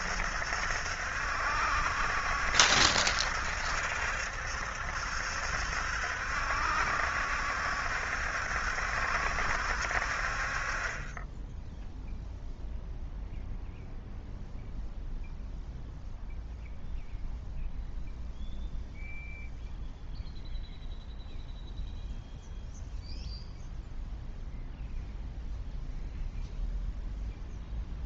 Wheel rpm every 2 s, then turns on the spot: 70, 70, 70, 70, 70, 40, 0, 0, 0, 0, 0, 0, 0, 0.
none